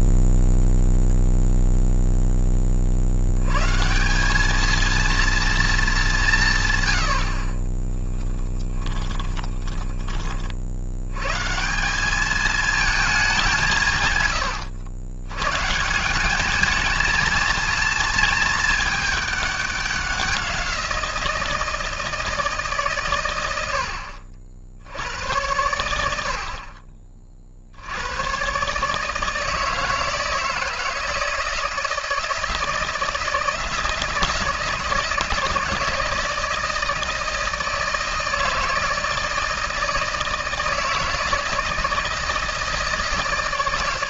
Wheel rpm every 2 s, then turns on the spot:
0, 40, 220, 120, 20, 60, 220, 100, 220, 220, 180, 150, 80, 40, 140, 160, 160, 160, 160, 160, 160, 160.
8-10